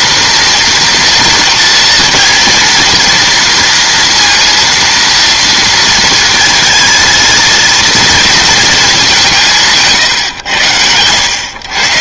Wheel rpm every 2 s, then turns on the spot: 230, 230, 230, 230, 220, 110.
none